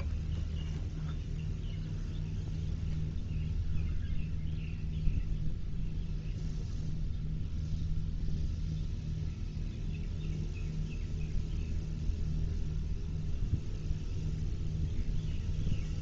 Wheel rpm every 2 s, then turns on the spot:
0, 0, 0, 0, 0, 0, 0, 0.
none